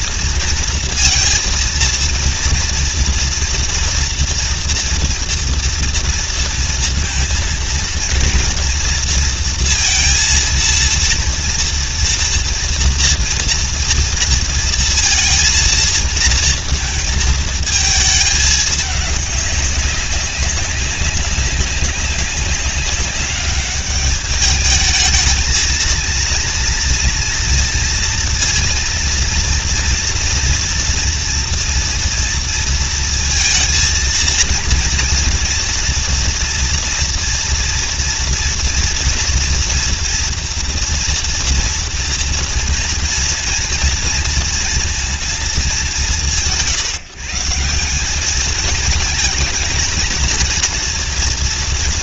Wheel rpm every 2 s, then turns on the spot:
230, 230, 230, 230, 230, 230, 230, 230, 230, 210, 190, 200, 210, 230, 230, 240, 230, 230, 230, 230, 230, 230, 230, 150, 220, 230.
none